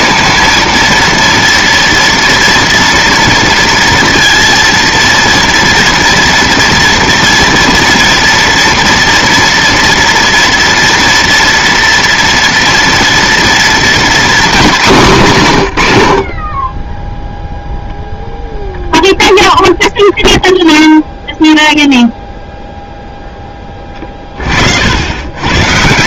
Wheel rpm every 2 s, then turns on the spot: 230, 230, 230, 240, 240, 230, 230, 220, 20, 0, 0, 0, 50.
none